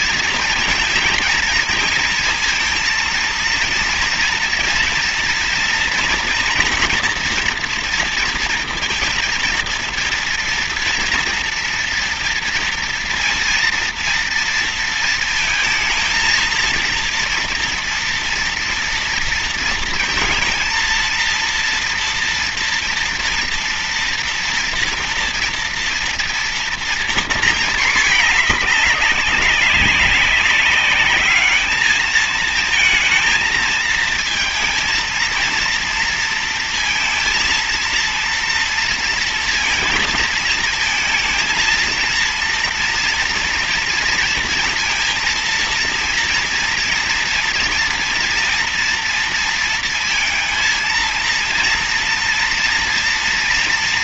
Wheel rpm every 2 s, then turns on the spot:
230, 230, 230, 240, 230, 230, 230, 230, 230, 240, 230, 230, 230, 230, 210, 190, 220, 220, 230, 230, 230, 230, 230, 230, 230, 230, 230.
none